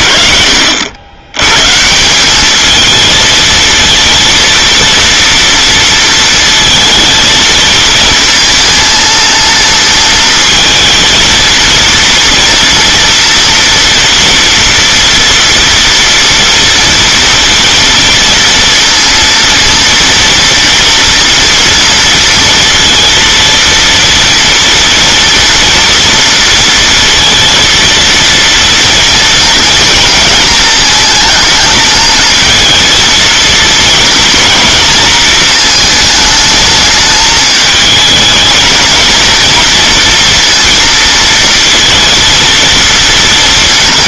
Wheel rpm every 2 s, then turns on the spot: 70, 220, 230, 230, 230, 230, 230, 230, 230, 230, 230, 230, 230, 230, 230, 220, 230, 230, 220, 230, 230, 230.
none